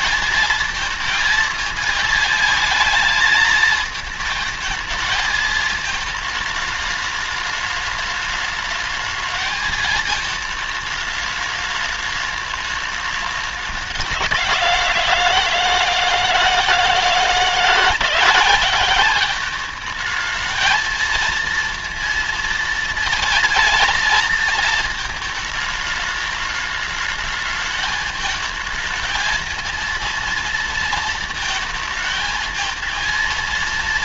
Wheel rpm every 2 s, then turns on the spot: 220, 220, 220, 210, 210, 220, 210, 170, 160, 190, 220, 230, 230, 210, 220, 230, 230.
none